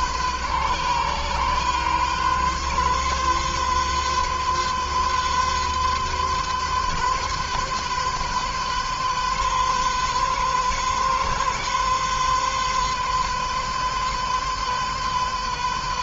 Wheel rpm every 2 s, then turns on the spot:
130, 130, 130, 130, 130, 130, 130, 130.
none